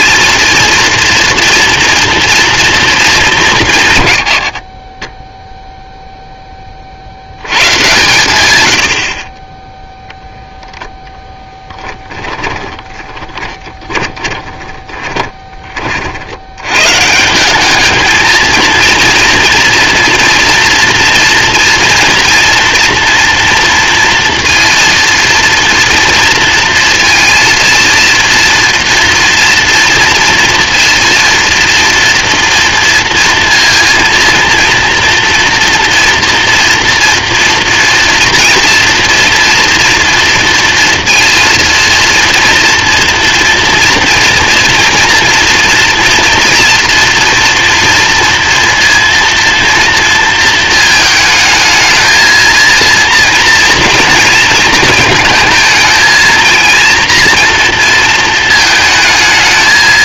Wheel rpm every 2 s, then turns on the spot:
230, 190, 10, 60, 80, 0, 20, 20, 120, 230, 230, 230, 230, 230, 230, 230, 230, 230, 230, 230, 230, 240, 230, 230, 230, 230, 230, 220, 230, 220.
12-16